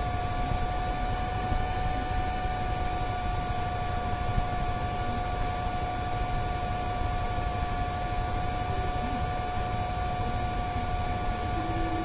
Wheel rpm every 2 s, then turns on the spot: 0, 0, 0, 0, 0, 0.
none